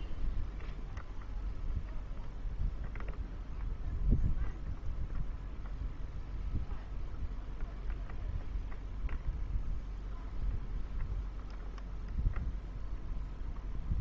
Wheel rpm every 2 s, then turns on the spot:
0, 0, 0, 0, 0, 0, 0.
none